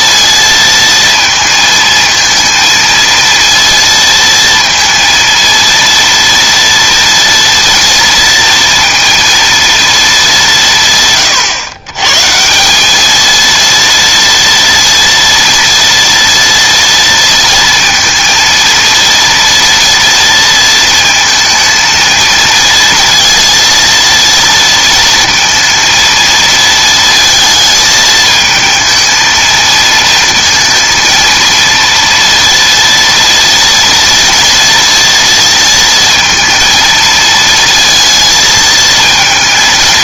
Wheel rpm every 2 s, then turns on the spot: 230, 220, 230, 230, 230, 170, 190, 230, 230, 230, 230, 230, 230, 230, 220, 230, 230, 230, 220, 220.
none